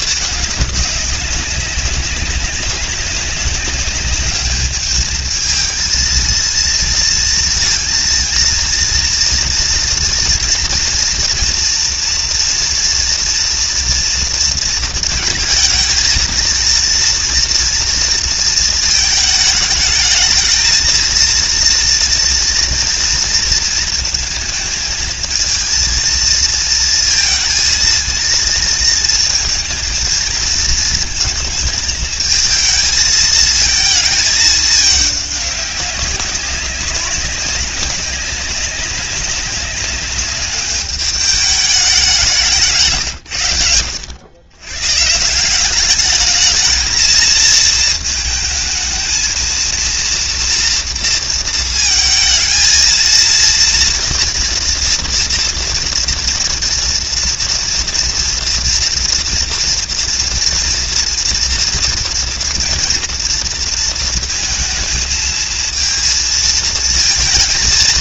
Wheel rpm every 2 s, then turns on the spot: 200, 190, 210, 230, 230, 230, 230, 230, 230, 220, 230, 230, 220, 230, 220, 220, 220, 210, 190, 190, 210, 150, 130, 220, 220, 230, 230, 230, 240, 230, 240, 240, 220, 230.
42-44